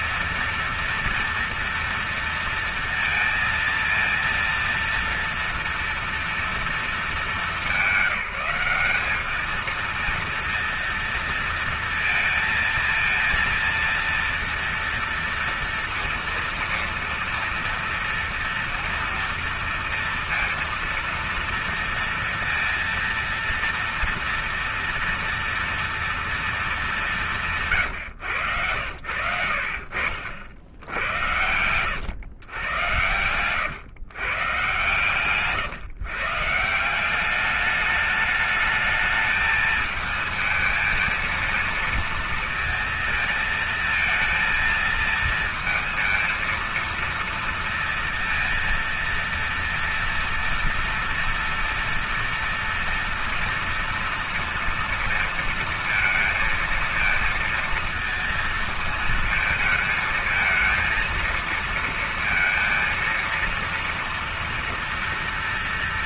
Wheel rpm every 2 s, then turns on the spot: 230, 230, 230, 230, 190, 230, 230, 230, 230, 230, 230, 230, 230, 230, 130, 60, 120, 130, 130, 210, 220, 230, 230, 230, 230, 230, 230, 230, 230, 230, 220, 230, 230.
none